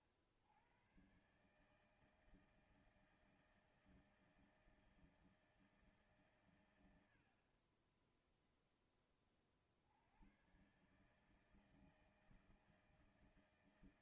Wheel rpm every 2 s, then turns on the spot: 70, 160, 160, 130, 10, 90, 160.
none